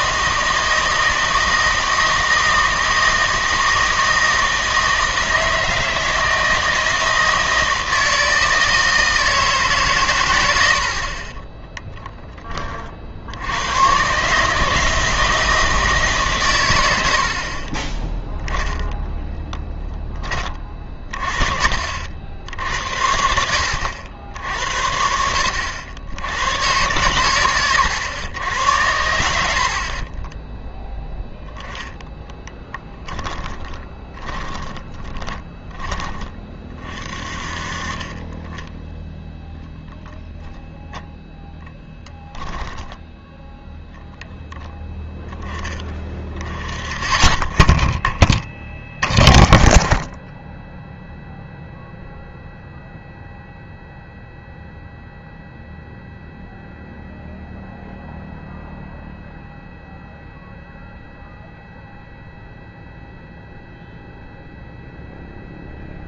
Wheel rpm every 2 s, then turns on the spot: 160, 160, 160, 160, 160, 80, 30, 150, 110, 10, 30, 80, 60, 110, 90, 0, 10, 20, 30, 10, 0, 0, 0, 20, 20, 10, 0, 0, 0, 0, 0, 0, 0.
32-36